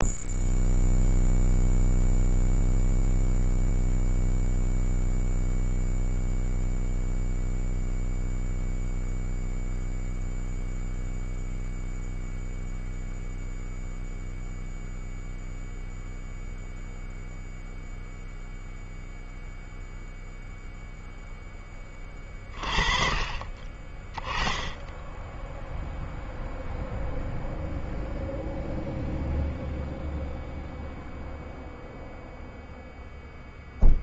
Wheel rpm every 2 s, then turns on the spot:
0, 0, 0, 0, 0, 0, 0, 0, 0, 0, 0, 30, 20, 0, 0, 0, 0.
none